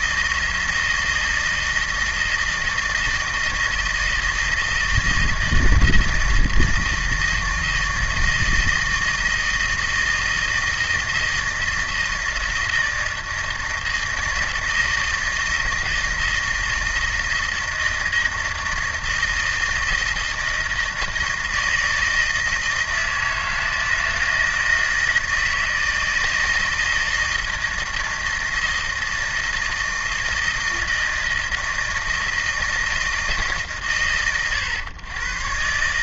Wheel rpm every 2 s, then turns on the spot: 160, 160, 160, 160, 160, 160, 160, 160, 160, 160, 160, 160, 160, 160, 160, 160, 160, 110.
none